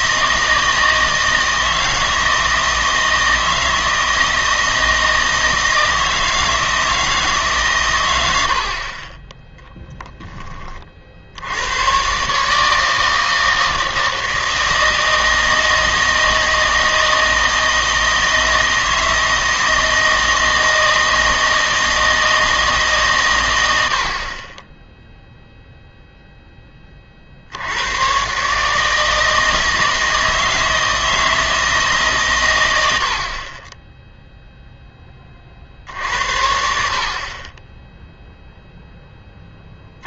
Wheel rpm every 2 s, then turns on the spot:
160, 160, 160, 160, 60, 30, 150, 160, 160, 160, 160, 150, 20, 20, 150, 160, 110, 0, 60, 0.
none